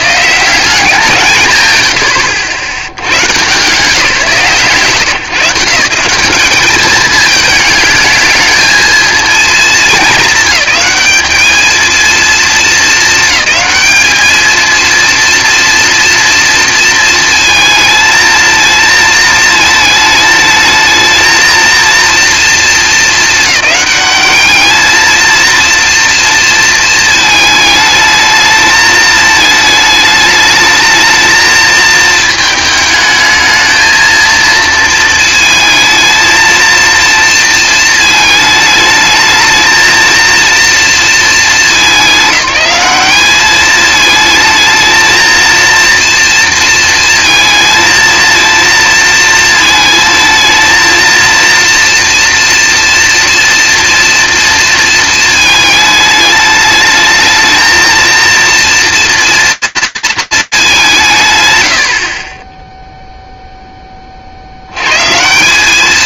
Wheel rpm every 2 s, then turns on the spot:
180, 80, 140, 210, 220, 200, 220, 230, 230, 220, 220, 220, 220, 220, 220, 220, 220, 230, 230, 220, 230, 200, 220, 230, 230, 230, 240, 230, 220, 230, 200, 10, 100.
none